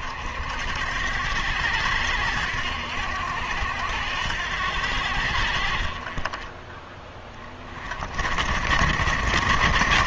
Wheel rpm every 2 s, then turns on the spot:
80, 80, 80, 20, 70.
none